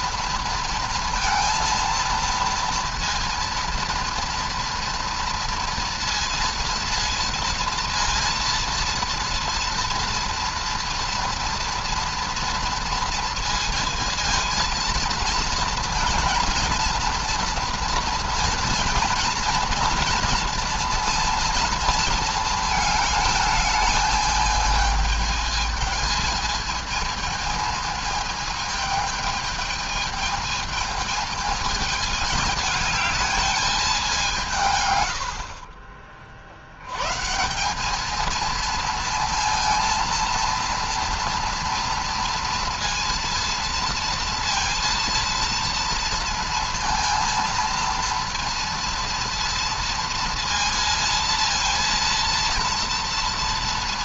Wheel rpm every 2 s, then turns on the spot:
230, 230, 230, 230, 230, 230, 230, 230, 230, 230, 230, 220, 220, 220, 220, 220, 210, 130, 100, 230, 230, 230, 230, 230, 230, 230, 230.
none